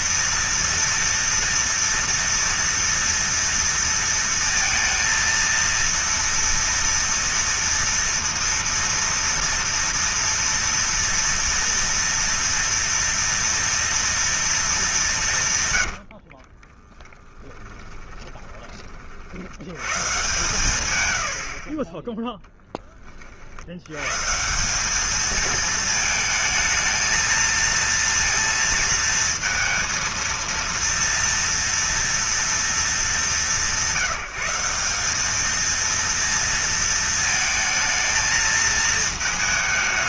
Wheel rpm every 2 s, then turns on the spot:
230, 230, 230, 230, 230, 230, 230, 200, 20, 30, 110, 20, 200, 220, 230, 230, 190, 200, 230, 220.
16-18